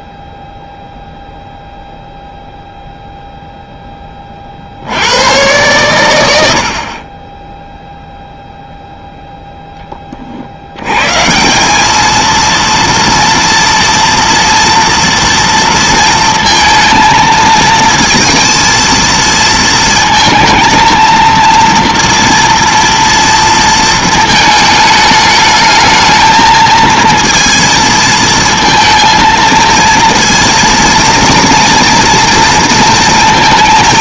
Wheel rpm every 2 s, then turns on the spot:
0, 0, 70, 60, 0, 110, 230, 230, 230, 230, 230, 230, 220, 230, 230, 230, 230.
none